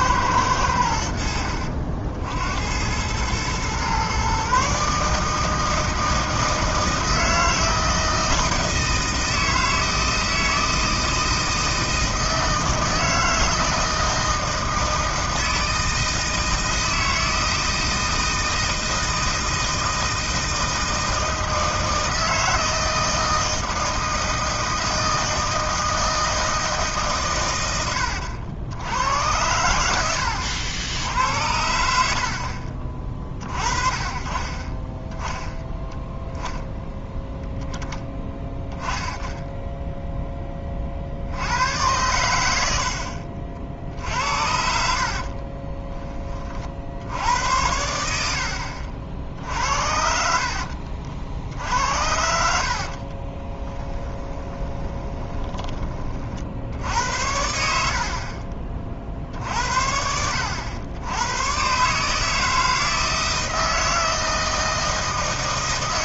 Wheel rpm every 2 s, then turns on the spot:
100, 80, 140, 160, 160, 160, 160, 160, 160, 160, 160, 160, 160, 150, 90, 70, 40, 20, 0, 10, 30, 80, 60, 50, 60, 60, 50, 20, 70, 50, 90, 160, 160.
50-56